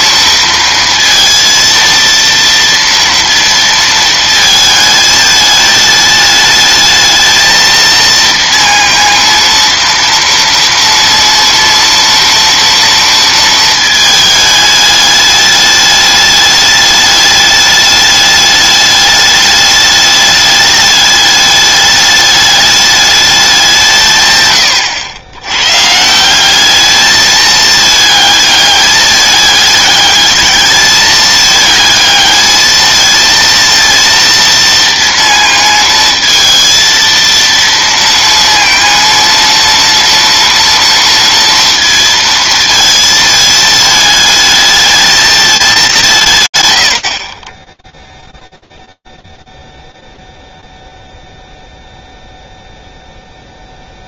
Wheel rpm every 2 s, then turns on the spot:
230, 230, 220, 220, 230, 230, 230, 210, 210, 210, 210, 210, 110, 200, 210, 210, 220, 230, 230, 230, 230, 230, 220, 110, 0, 0, 0.
none